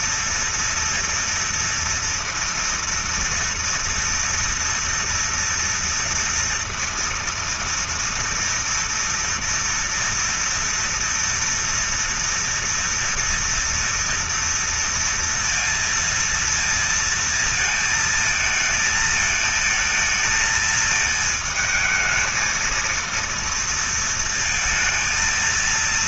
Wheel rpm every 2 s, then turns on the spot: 230, 230, 230, 230, 230, 230, 230, 230, 230, 220, 220, 220, 220.
none